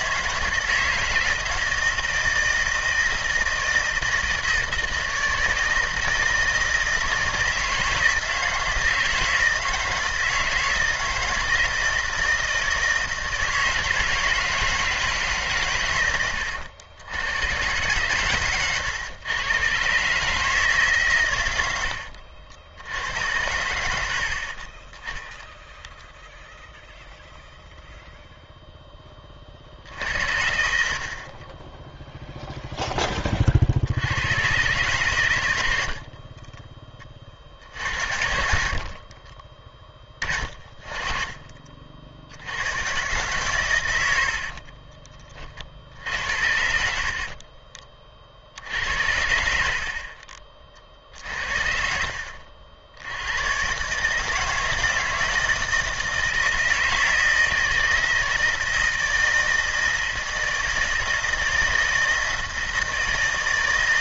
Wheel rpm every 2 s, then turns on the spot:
160, 160, 160, 170, 160, 170, 160, 160, 90, 120, 140, 90, 20, 0, 10, 50, 10, 130, 20, 50, 30, 120, 30, 60, 80, 50, 70, 160, 160, 160, 160, 160.
38-42 44-46